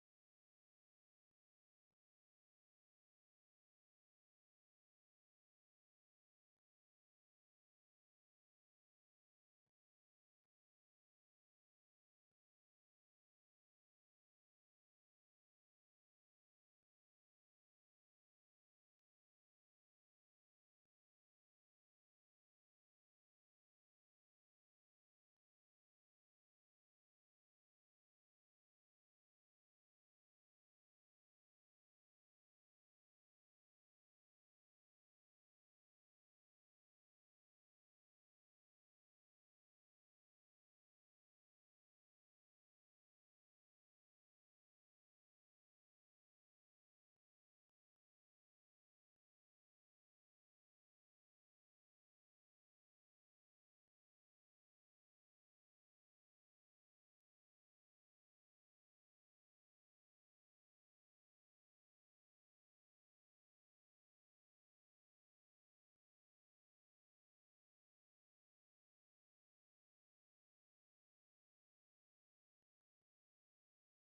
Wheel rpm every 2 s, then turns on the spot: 0, 0, 0, 0, 0, 0, 0, 0, 0, 0, 0, 0, 0, 0, 0, 0, 0, 0, 0, 0, 0, 0, 0, 0, 0, 0, 0, 0, 0, 0, 0, 0, 0, 0, 0, 0, 0.
none